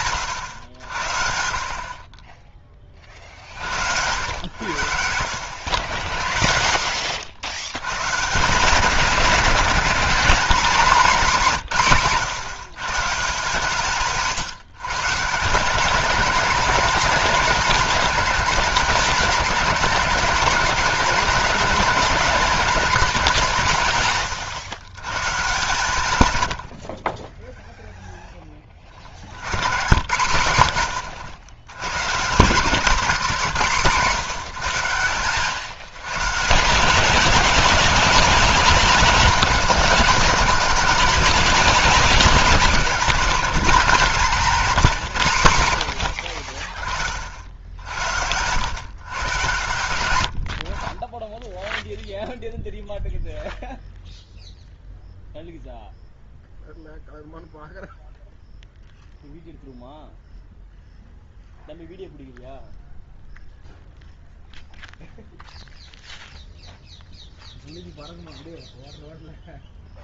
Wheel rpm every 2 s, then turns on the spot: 90, 30, 80, 80, 170, 210, 150, 140, 220, 210, 220, 220, 120, 60, 30, 100, 200, 160, 160, 210, 200, 200, 200, 40, 110, 50, 0, 0, 0, 0, 0, 0, 0, 0, 0.
28-30